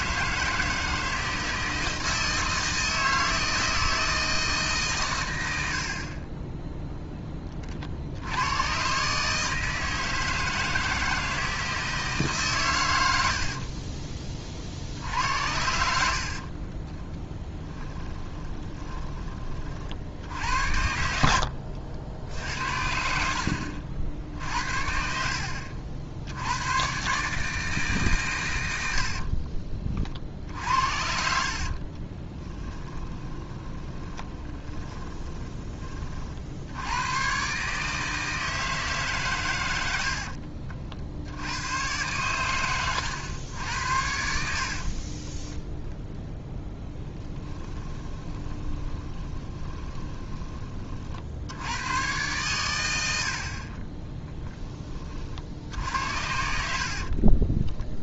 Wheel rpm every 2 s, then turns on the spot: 160, 160, 140, 0, 110, 160, 130, 60, 30, 10, 70, 70, 60, 120, 90, 70, 20, 20, 90, 160, 50, 100, 50, 0, 20, 30, 110, 20, 70.
16-20 24-26 30-36 42-46 48-50 56-58